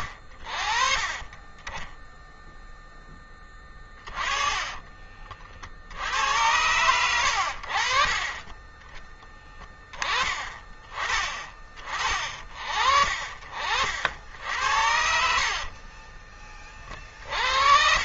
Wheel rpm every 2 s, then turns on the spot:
30, 10, 30, 90, 20, 30, 50, 70, 30.
6-8